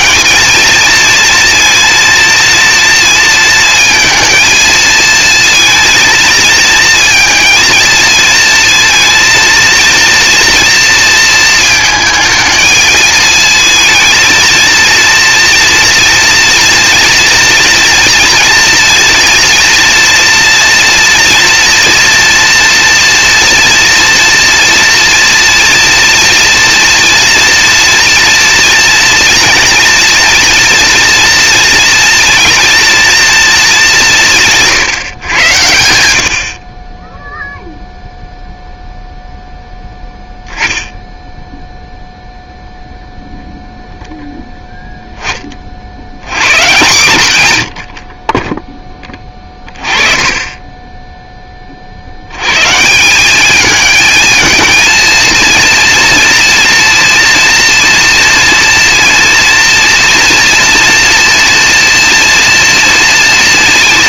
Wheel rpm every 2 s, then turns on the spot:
230, 230, 230, 230, 230, 230, 230, 220, 230, 230, 230, 240, 240, 230, 230, 230, 230, 160, 50, 0, 10, 0, 10, 130, 20, 20, 120, 220, 230, 230, 230, 230.
50-52